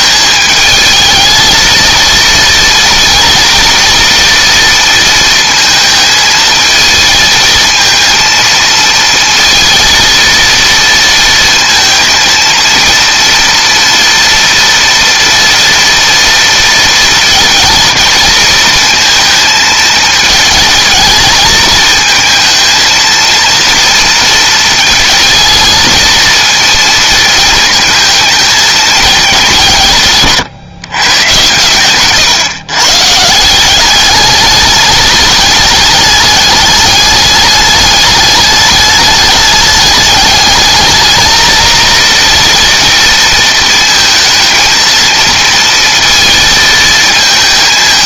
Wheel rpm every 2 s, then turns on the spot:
220, 230, 230, 220, 230, 230, 230, 230, 230, 220, 220, 220, 230, 230, 220, 130, 130, 200, 210, 210, 210, 230, 230, 230.
none